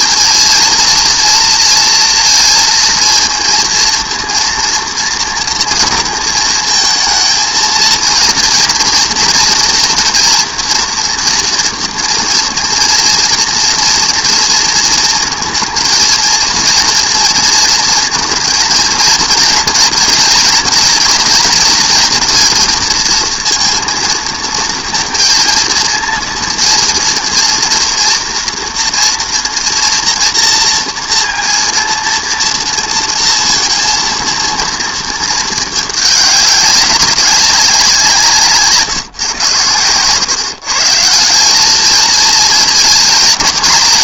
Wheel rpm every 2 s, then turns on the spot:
230, 230, 230, 230, 230, 240, 230, 230, 230, 230, 230, 220, 220, 230, 230, 230, 230, 220, 200, 150, 150, 230.
none